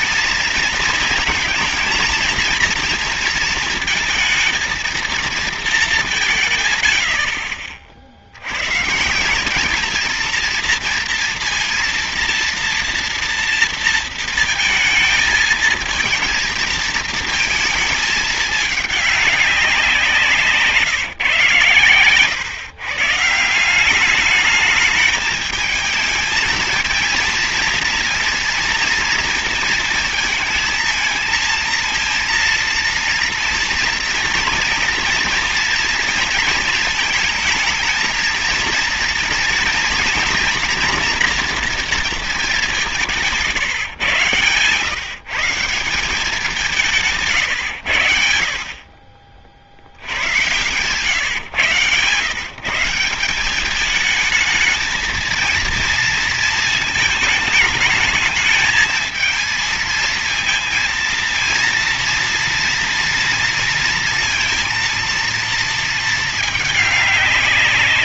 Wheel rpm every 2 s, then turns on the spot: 230, 230, 220, 140, 100, 230, 230, 230, 230, 210, 160, 130, 210, 220, 230, 220, 230, 230, 220, 230, 230, 210, 130, 180, 70, 110, 150, 220, 220, 220, 230, 230, 230, 220.
none